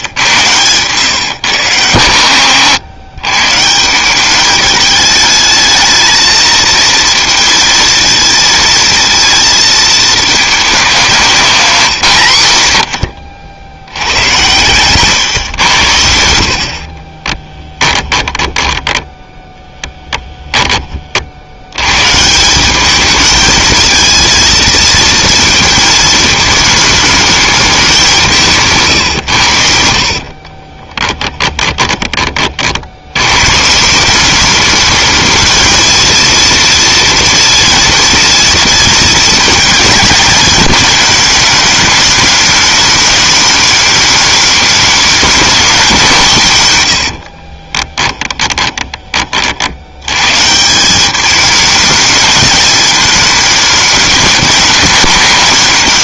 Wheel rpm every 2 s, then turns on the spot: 110, 100, 210, 230, 230, 220, 80, 120, 60, 10, 10, 190, 230, 220, 150, 30, 50, 210, 230, 230, 220, 210, 210, 140, 20, 150, 220, 210.
16-20 30-32 48-50